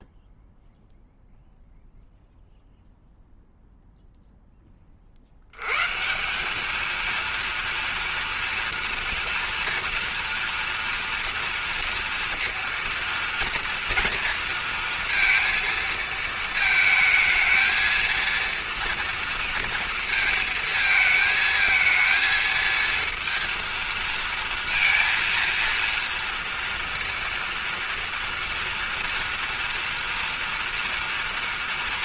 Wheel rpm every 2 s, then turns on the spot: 0, 0, 20, 200, 230, 230, 230, 230, 220, 230, 220, 230, 230, 230, 230, 230.
none